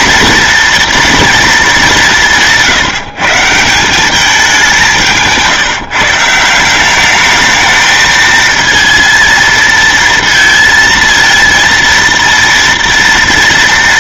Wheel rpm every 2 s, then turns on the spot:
230, 170, 190, 170, 220, 230, 230.
none